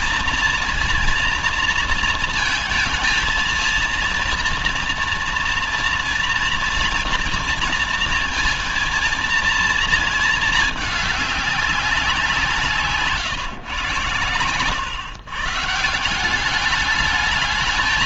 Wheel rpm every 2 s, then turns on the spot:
230, 220, 230, 230, 230, 220, 180, 120, 200.
none